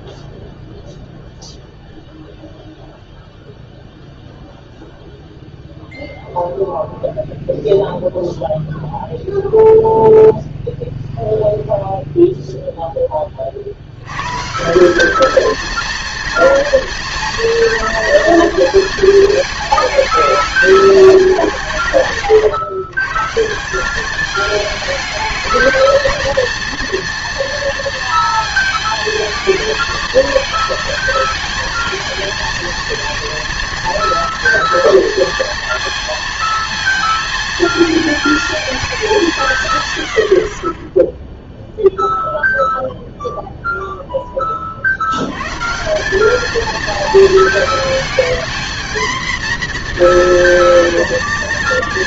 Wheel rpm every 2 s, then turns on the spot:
0, 0, 0, 0, 0, 0, 0, 160, 240, 230, 220, 130, 220, 230, 230, 230, 230, 230, 230, 220, 30, 0, 30, 220, 230, 230.
none